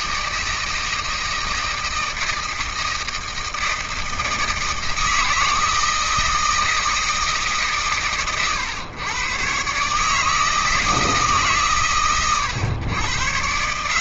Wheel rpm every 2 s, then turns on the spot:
160, 160, 160, 160, 120, 160, 110.
none